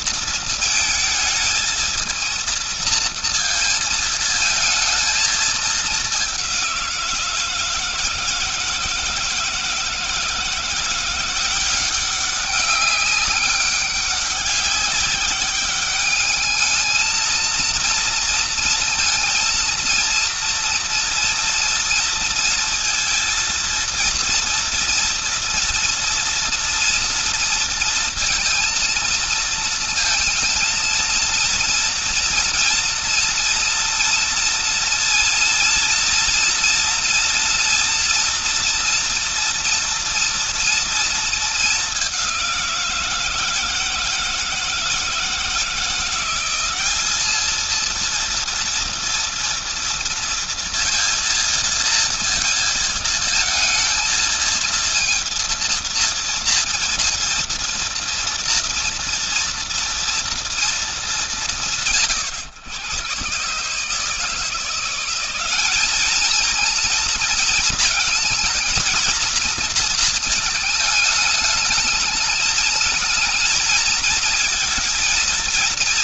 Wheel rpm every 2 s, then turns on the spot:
220, 230, 220, 170, 160, 170, 200, 200, 220, 230, 230, 230, 230, 230, 220, 230, 230, 240, 240, 240, 230, 170, 160, 210, 230, 230, 230, 230, 230, 230, 200, 110, 180, 230, 230, 210, 220, 230.
none